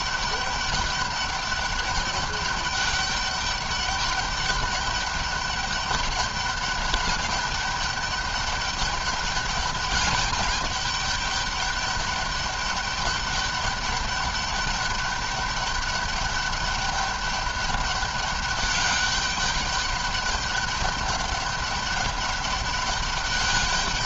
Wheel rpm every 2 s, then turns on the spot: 200, 200, 200, 200, 200, 200, 210, 200, 200, 200, 200, 200.
none